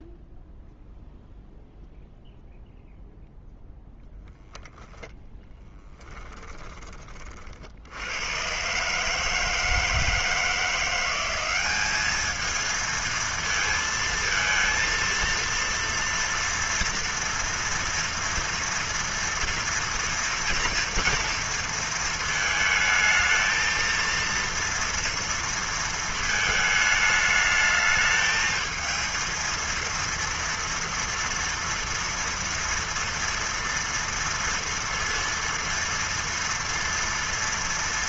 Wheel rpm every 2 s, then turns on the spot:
0, 0, 0, 20, 130, 170, 220, 230, 230, 230, 230, 220, 230, 210, 220, 230, 240, 230, 230.
none